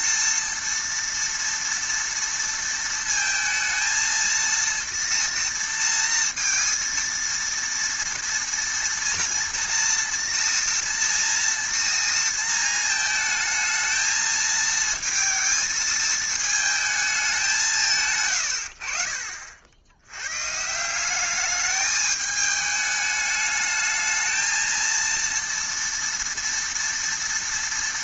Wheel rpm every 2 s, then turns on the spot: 230, 230, 230, 230, 230, 230, 230, 220, 220, 80, 150, 210, 230, 230.
none